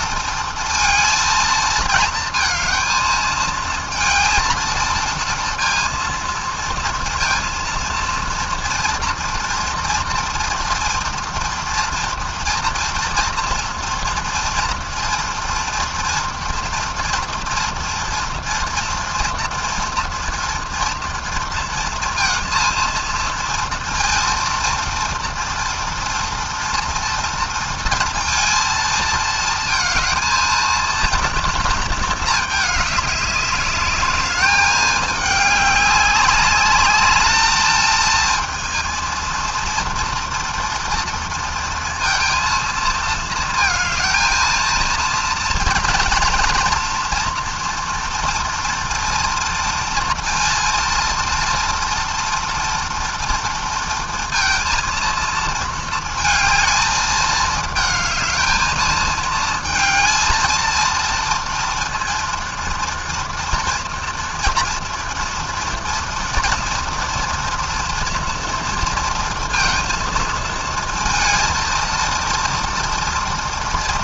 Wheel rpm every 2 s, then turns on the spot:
230, 220, 230, 230, 230, 230, 230, 230, 230, 230, 230, 230, 230, 230, 220, 230, 210, 210, 210, 230, 230, 220, 230, 230, 230, 230, 230, 230, 220, 220, 230, 230, 230, 230, 230, 230, 230.
none